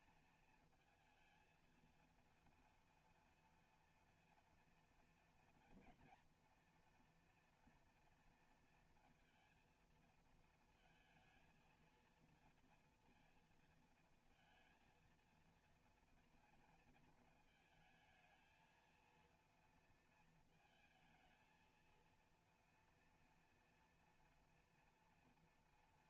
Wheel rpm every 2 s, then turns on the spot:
220, 230, 230, 230, 230, 220, 230, 230, 230, 220, 230, 230, 240.
none